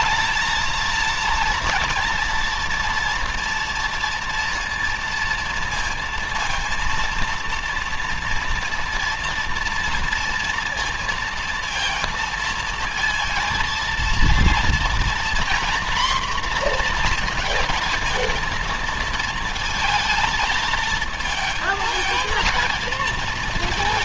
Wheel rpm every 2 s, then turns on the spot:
220, 230, 230, 230, 230, 230, 220, 230, 240, 220, 220, 230.
none